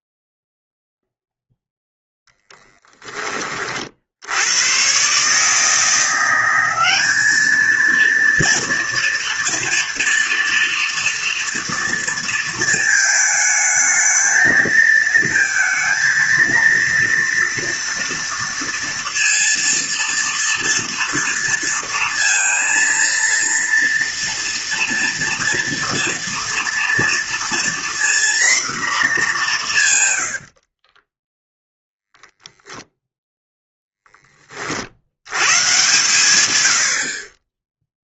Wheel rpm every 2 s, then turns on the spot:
0, 10, 130, 200, 230, 240, 220, 220, 230, 230, 230, 230, 230, 230, 230, 20, 0, 70, 50.
30-32